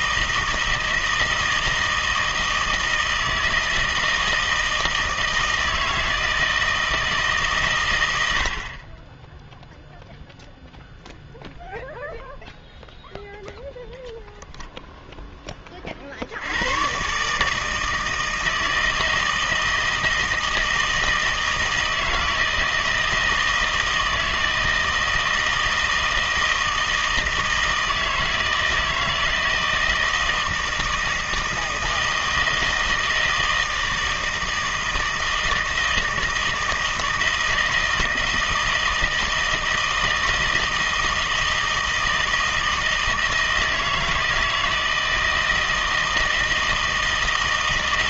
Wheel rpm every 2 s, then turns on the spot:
160, 160, 160, 160, 40, 0, 0, 0, 100, 160, 160, 160, 160, 160, 160, 160, 160, 160, 160, 160, 160, 160, 160, 160.
none